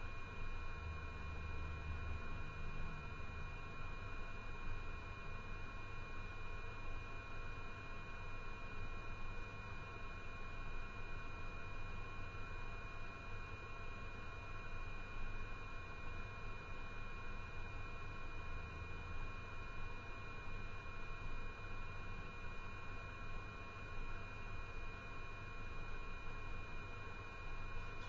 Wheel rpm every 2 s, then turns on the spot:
0, 0, 0, 0, 0, 0, 0, 0, 0, 0, 0, 0, 0, 0.
none